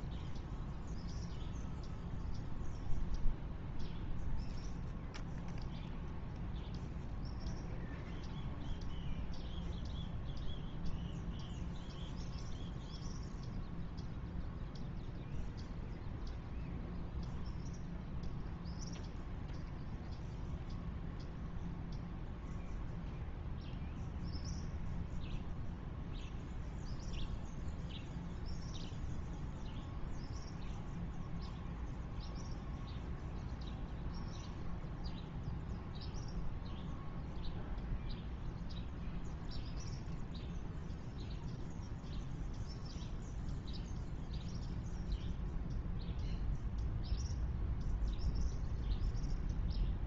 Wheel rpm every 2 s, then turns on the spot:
0, 0, 0, 0, 0, 0, 0, 0, 0, 0, 0, 0, 0, 0, 0, 0, 0, 0, 0, 0, 0, 0, 0, 0, 0.
none